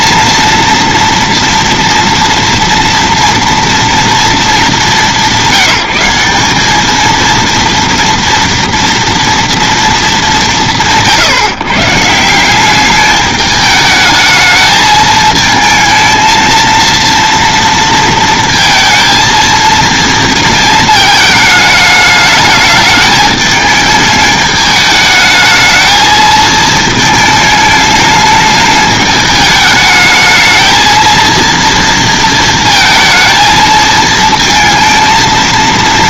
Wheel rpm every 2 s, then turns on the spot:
230, 230, 220, 210, 230, 170, 190, 220, 230, 230, 230, 210, 210, 220, 210, 220, 230, 230.
none